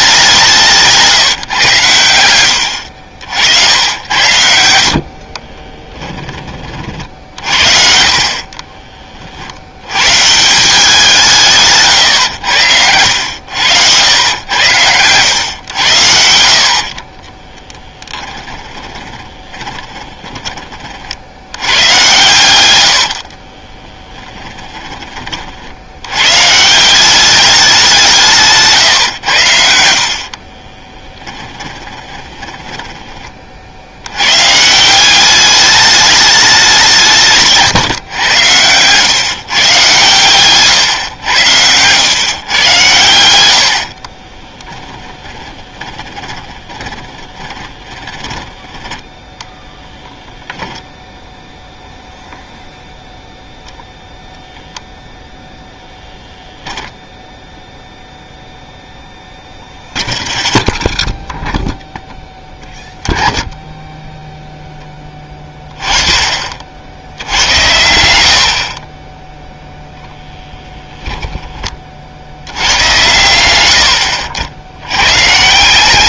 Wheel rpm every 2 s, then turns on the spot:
180, 90, 80, 30, 40, 170, 100, 100, 50, 20, 20, 110, 20, 140, 150, 30, 20, 130, 200, 110, 120, 110, 20, 20, 10, 0, 0, 0, 0, 0, 0, 10, 0, 40, 60, 10, 90, 80.
8-10 18-20 22-26 30-34 44-50 70-72